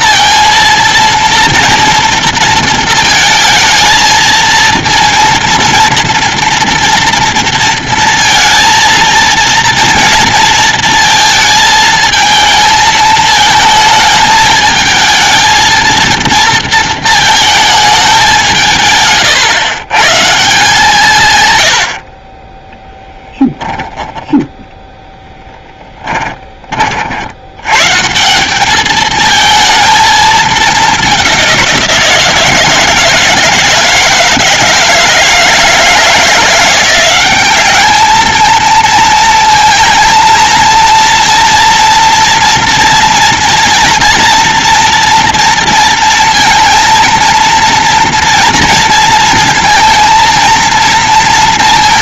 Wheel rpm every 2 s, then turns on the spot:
230, 230, 230, 230, 230, 230, 220, 220, 220, 140, 170, 10, 10, 40, 220, 200, 160, 160, 180, 230, 230, 230, 240, 230, 230, 230.
22-24